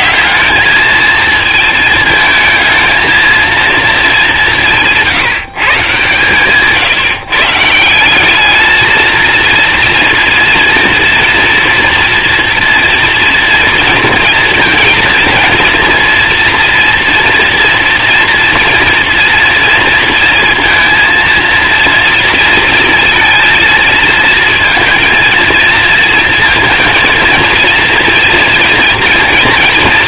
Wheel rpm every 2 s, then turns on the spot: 220, 220, 170, 150, 230, 230, 230, 230, 230, 230, 230, 230, 230, 230, 230.
none